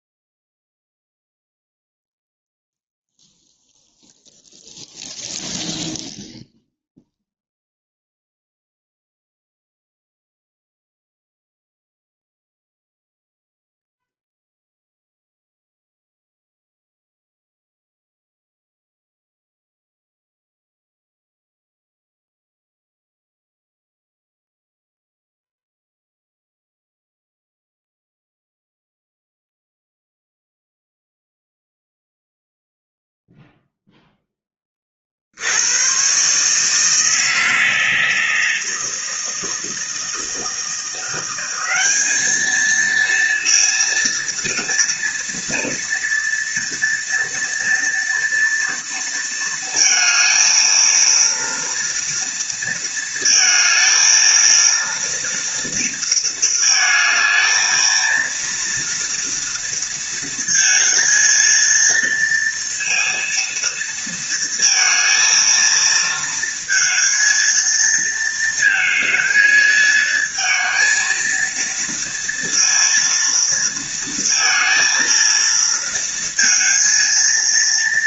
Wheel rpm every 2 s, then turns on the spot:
0, 0, 0, 0, 0, 0, 0, 0, 0, 0, 0, 0, 0, 0, 0, 0, 0, 20, 150, 160, 170, 230, 230, 230, 230, 230, 230, 230, 220, 230, 230, 230, 230, 220, 220, 220, 230, 230, 230.
none